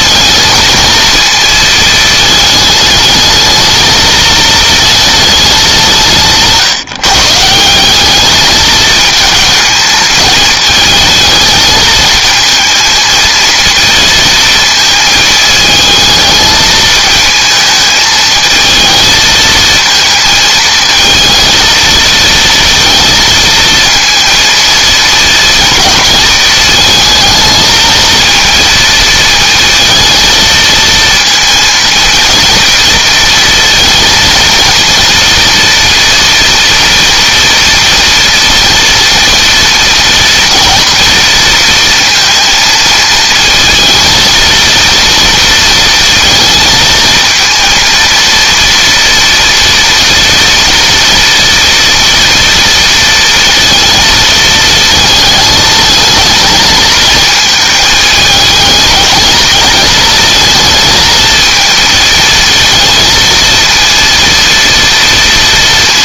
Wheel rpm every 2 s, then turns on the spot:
230, 220, 220, 150, 210, 220, 220, 220, 220, 220, 230, 230, 230, 220, 230, 230, 230, 230, 230, 230, 240, 220, 230, 230, 240, 230, 230, 220, 220, 220, 220, 230, 230.
none